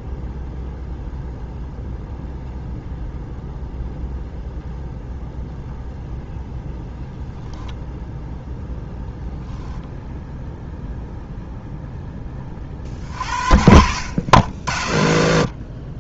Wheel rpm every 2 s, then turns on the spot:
0, 0, 0, 10, 0, 0, 30, 80.
none